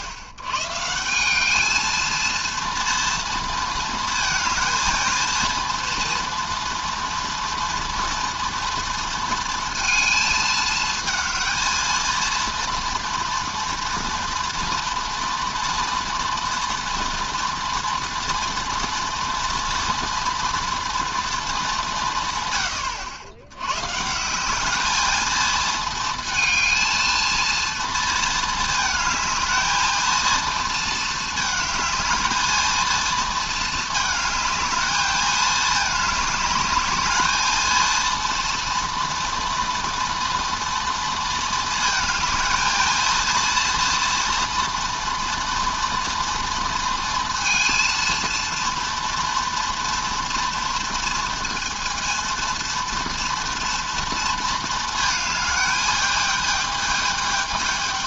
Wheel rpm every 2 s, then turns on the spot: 110, 230, 220, 230, 230, 220, 230, 240, 240, 230, 230, 120, 190, 230, 220, 220, 220, 220, 210, 230, 230, 220, 240, 230, 230, 230, 230, 220, 220.
none